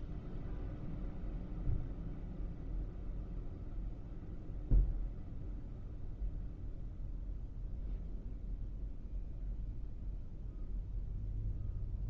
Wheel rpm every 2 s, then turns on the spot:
0, 0, 0, 0, 0, 0.
none